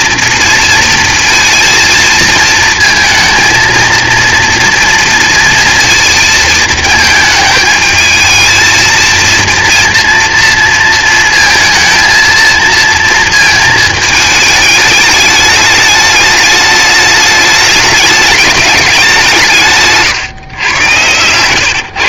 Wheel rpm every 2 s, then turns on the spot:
230, 220, 230, 220, 230, 230, 230, 210, 210, 200, 120.
20-22